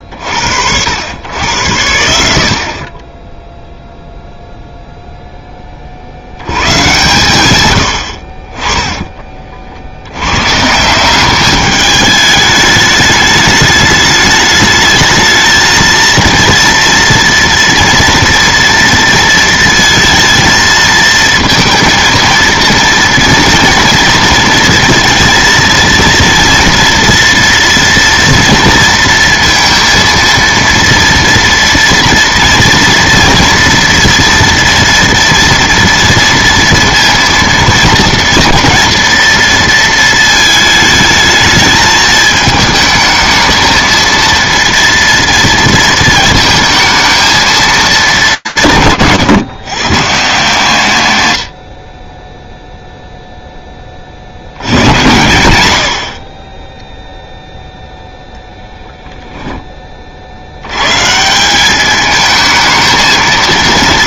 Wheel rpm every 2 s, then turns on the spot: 70, 40, 0, 120, 30, 160, 210, 210, 230, 230, 230, 230, 230, 240, 230, 230, 240, 230, 230, 230, 220, 220, 230, 230, 130, 150, 0, 90, 10, 0, 140, 220.
none